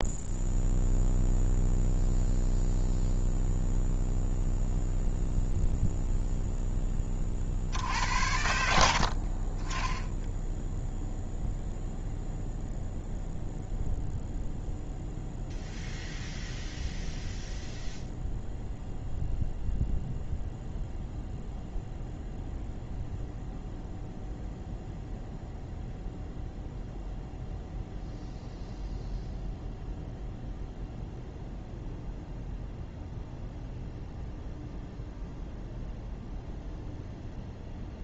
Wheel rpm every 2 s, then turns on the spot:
0, 0, 0, 10, 80, 0, 0, 0, 0, 0, 0, 0, 0, 0, 0, 0, 0, 0, 0.
none